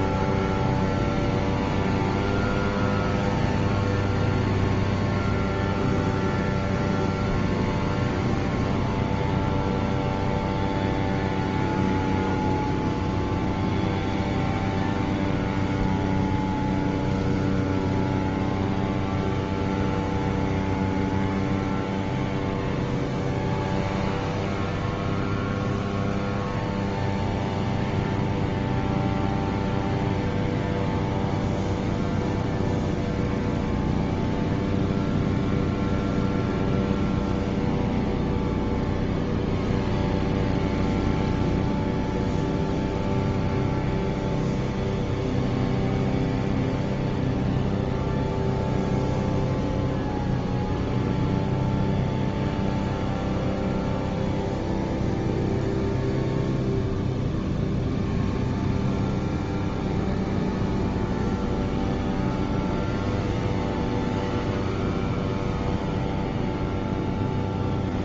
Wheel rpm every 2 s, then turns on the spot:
0, 0, 0, 0, 0, 0, 0, 0, 0, 0, 0, 0, 0, 0, 0, 0, 0, 0, 0, 0, 0, 0, 0, 0, 0, 0, 0, 0, 0, 0, 0, 0, 0, 0.
none